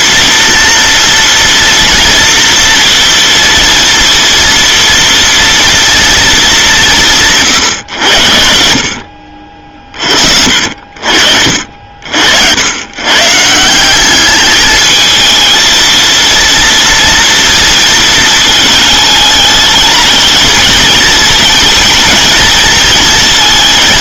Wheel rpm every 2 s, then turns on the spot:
230, 230, 230, 200, 50, 60, 90, 210, 230, 220, 220, 220.
none